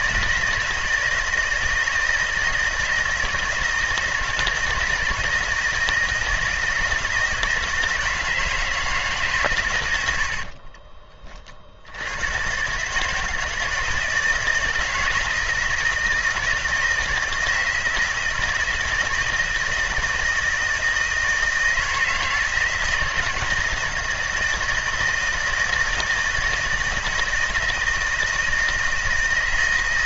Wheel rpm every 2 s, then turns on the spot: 160, 160, 160, 160, 160, 30, 130, 160, 160, 160, 160, 160, 160, 160, 160.
10-12